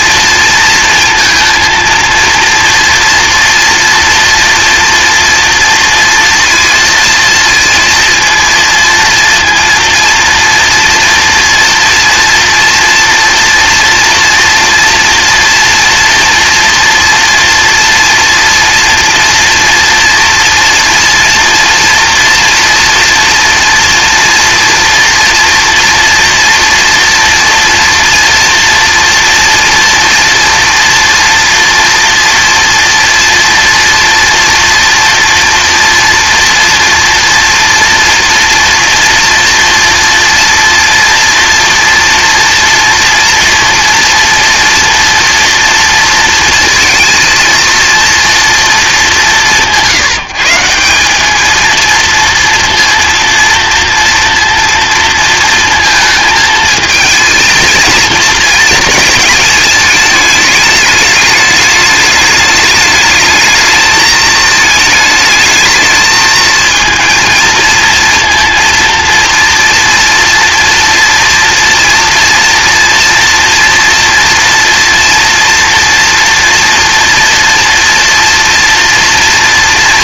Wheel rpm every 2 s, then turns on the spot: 230, 230, 230, 230, 230, 230, 230, 230, 230, 230, 230, 230, 230, 230, 230, 240, 230, 240, 230, 240, 230, 240, 240, 230, 230, 180, 230, 230, 220, 230, 210, 210, 220, 230, 230, 230, 230, 230, 230, 230.
none